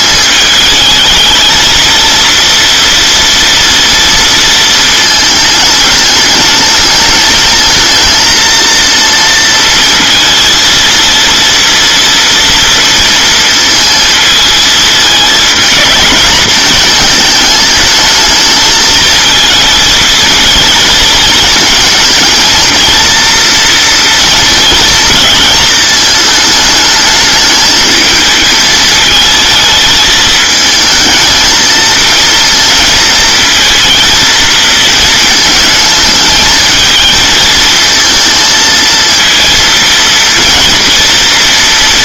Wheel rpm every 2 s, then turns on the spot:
210, 230, 230, 220, 230, 230, 230, 220, 220, 220, 220, 230, 230, 210, 220, 220, 230, 220, 220, 220, 230.
none